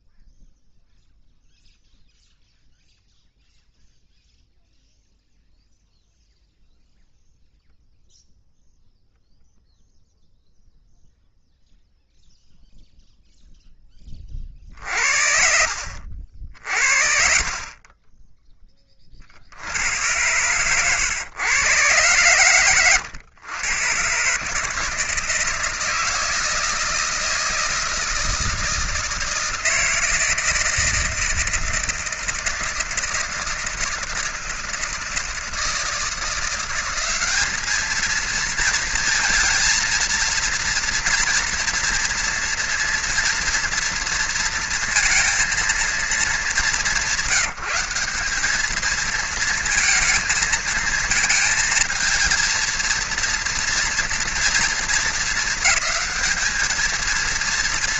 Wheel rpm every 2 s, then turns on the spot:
0, 0, 0, 0, 0, 0, 0, 30, 50, 20, 110, 120, 140, 160, 160, 160, 160, 160, 170, 220, 230, 230, 230, 210, 200, 220, 230, 230, 220.
20-22